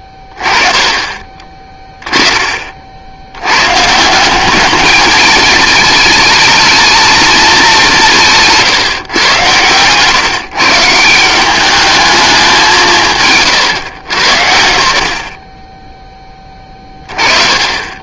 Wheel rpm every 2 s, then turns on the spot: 10, 30, 210, 220, 160, 160, 170, 90, 20.
none